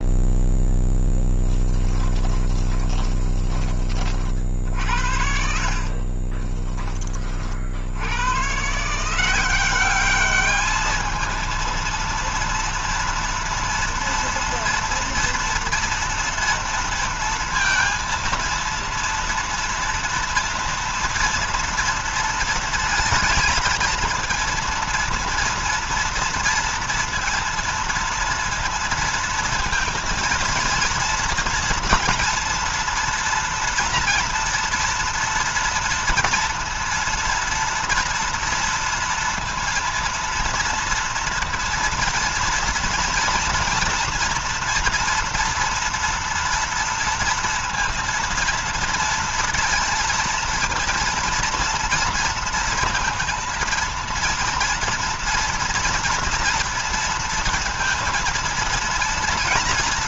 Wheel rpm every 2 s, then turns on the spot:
0, 20, 60, 20, 140, 210, 230, 230, 230, 230, 230, 230, 230, 230, 230, 230, 240, 240, 230, 230, 230, 230, 240, 230, 230, 230, 230, 230, 230, 230.
2-8